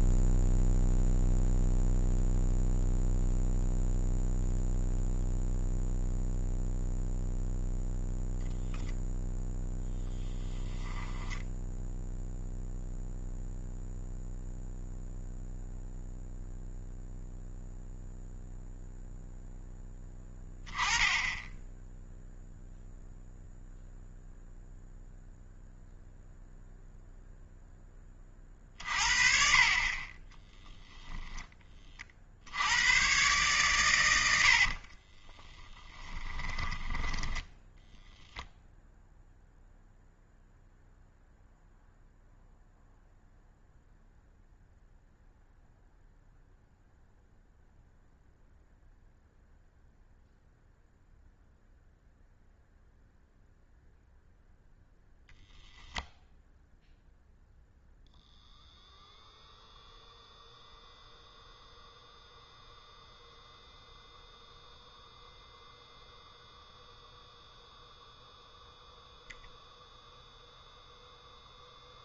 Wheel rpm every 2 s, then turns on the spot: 0, 0, 0, 0, 0, 10, 0, 0, 0, 0, 10, 0, 0, 0, 50, 10, 80, 70, 20, 0, 0, 0, 0, 0, 0, 0, 0, 0, 0, 0, 0, 0, 0, 0, 0, 0.
10-12 28-32 34-38